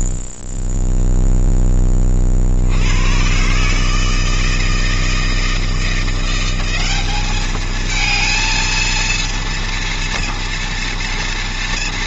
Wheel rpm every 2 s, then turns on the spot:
0, 60, 160, 180, 230, 230.
none